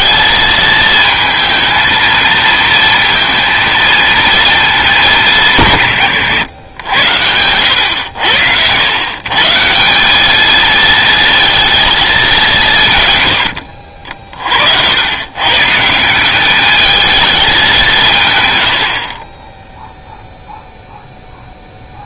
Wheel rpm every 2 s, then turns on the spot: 220, 230, 200, 90, 110, 220, 160, 90, 220, 70, 0.
none